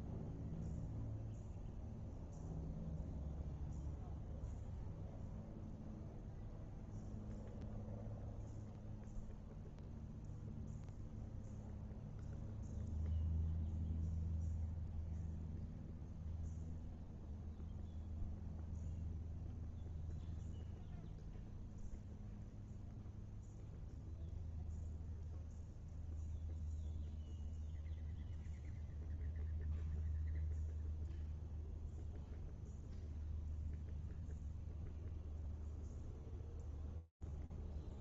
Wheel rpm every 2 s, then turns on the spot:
0, 0, 0, 0, 0, 0, 0, 0, 0, 0, 0, 0, 0, 0, 0, 0, 0, 0, 0.
none